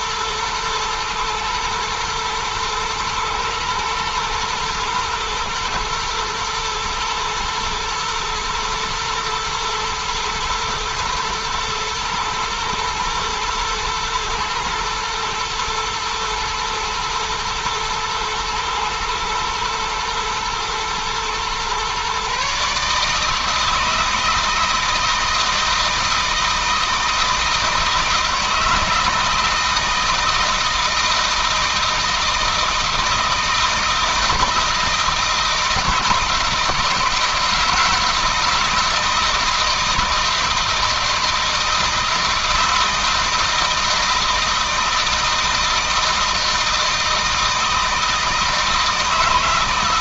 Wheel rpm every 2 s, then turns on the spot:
110, 120, 110, 110, 120, 110, 110, 120, 120, 110, 120, 150, 160, 160, 160, 170, 170, 160, 160, 160, 160, 160, 160, 160, 160.
none